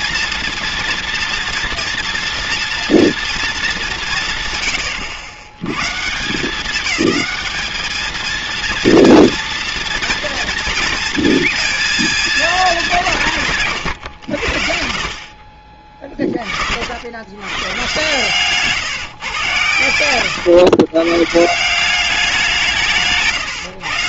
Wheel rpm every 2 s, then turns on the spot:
230, 230, 120, 210, 230, 230, 200, 60, 60, 150, 120, 160.
none